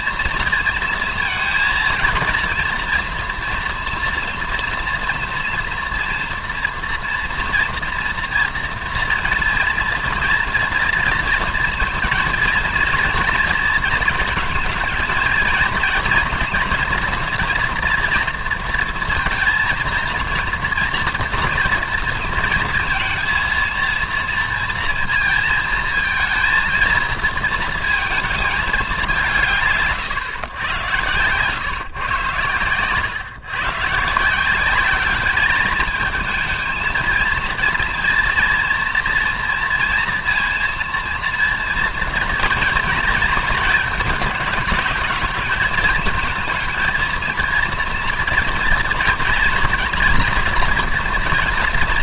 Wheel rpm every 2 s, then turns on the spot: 230, 230, 230, 230, 230, 230, 230, 220, 230, 230, 230, 230, 230, 230, 220, 120, 120, 170, 220, 230, 230, 240, 210, 230, 230, 230.
none